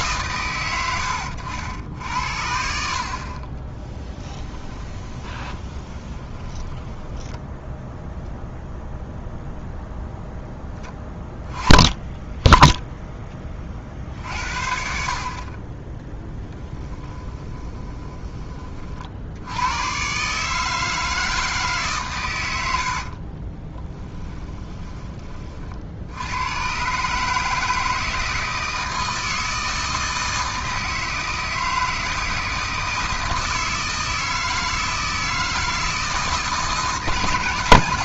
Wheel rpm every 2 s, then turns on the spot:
100, 50, 20, 20, 0, 10, 10, 60, 10, 40, 160, 60, 20, 130, 160, 160, 160, 160, 160.
4-8 16-18 22-24